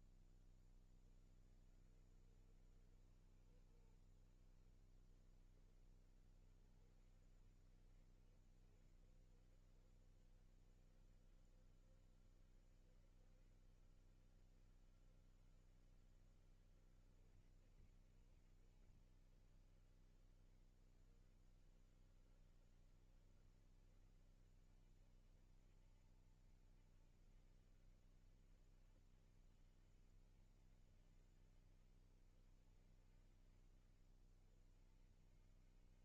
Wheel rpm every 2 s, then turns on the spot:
20, 60, 40, 60, 60, 70, 70, 70, 70, 70, 60, 70, 70, 70, 80, 70, 70, 70.
none